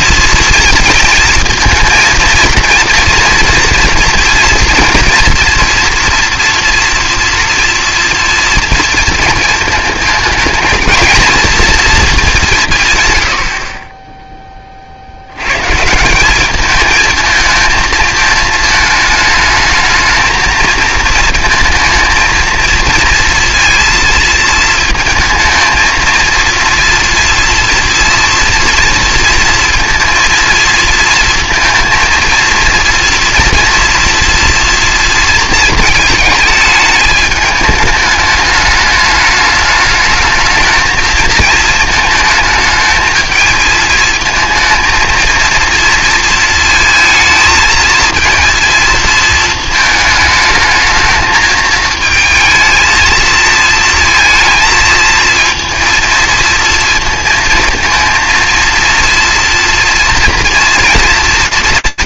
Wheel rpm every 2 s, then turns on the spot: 230, 230, 230, 230, 230, 220, 140, 50, 210, 220, 220, 230, 220, 230, 230, 220, 230, 230, 210, 210, 220, 220, 230, 220, 220, 220, 220, 230, 230, 230, 230.
none